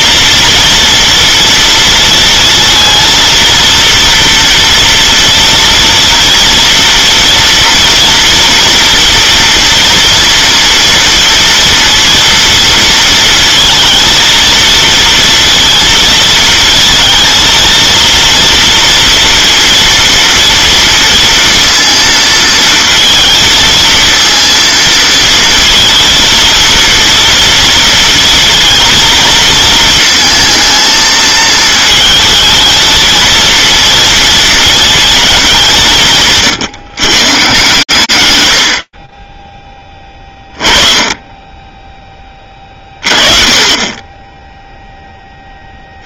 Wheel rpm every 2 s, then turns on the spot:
230, 230, 230, 230, 230, 230, 230, 230, 230, 230, 230, 230, 230, 230, 220, 230, 220, 230, 130, 80, 20, 20, 10.
none